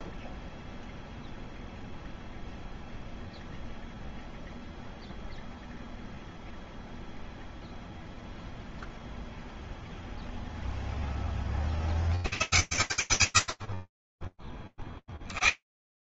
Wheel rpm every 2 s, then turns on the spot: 0, 0, 0, 0, 0, 30, 80, 40.
none